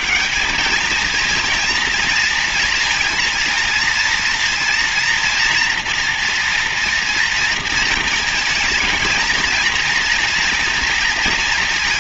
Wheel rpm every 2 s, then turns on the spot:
210, 230, 230, 230, 220, 230.
none